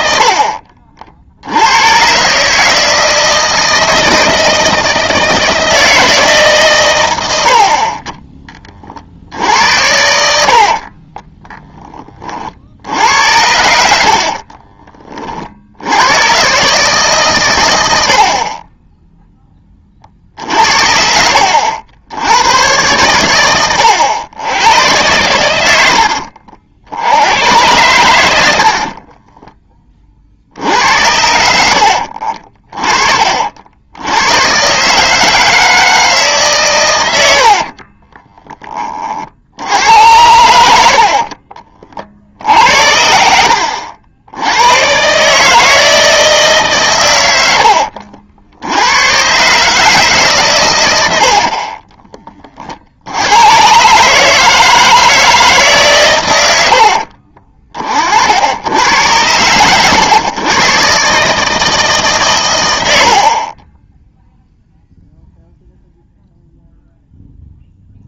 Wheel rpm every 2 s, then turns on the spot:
60, 150, 160, 130, 30, 50, 60, 40, 130, 10, 60, 110, 100, 70, 50, 70, 50, 130, 110, 20, 70, 70, 100, 150, 90, 110, 40, 160, 100, 90, 130, 90, 0, 0.
0-2 14-16 28-30